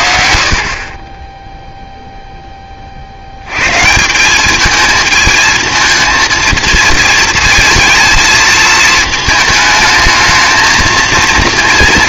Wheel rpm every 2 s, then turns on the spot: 50, 20, 210, 230, 220, 230.
none